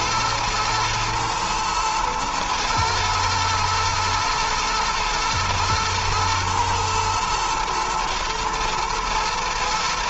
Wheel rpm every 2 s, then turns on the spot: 110, 110, 120, 110, 110.
none